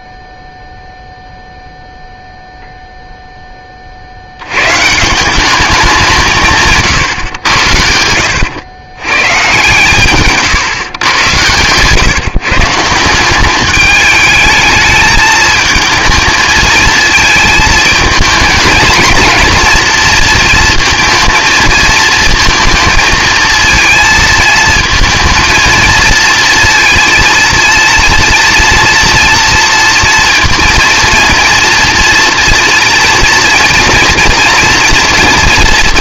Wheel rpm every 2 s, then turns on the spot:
0, 0, 130, 140, 110, 120, 170, 220, 220, 230, 230, 220, 220, 230, 240, 230, 230, 240.
none